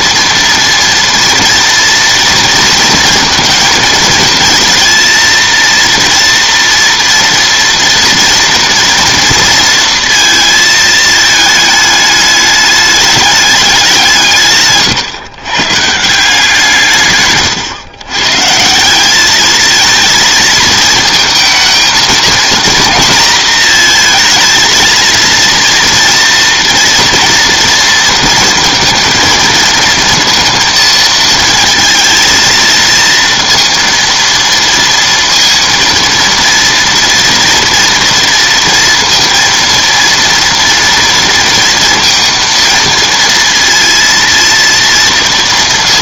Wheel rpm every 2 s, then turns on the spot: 230, 230, 230, 230, 230, 220, 210, 140, 150, 170, 220, 230, 220, 230, 230, 230, 230, 230, 230, 230, 230, 230, 230.
none